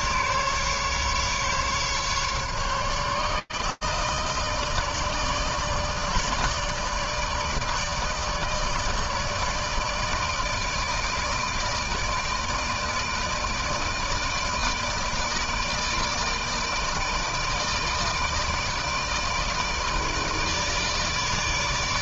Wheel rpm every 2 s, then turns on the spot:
150, 150, 160, 160, 160, 160, 160, 160, 160, 160, 150.
none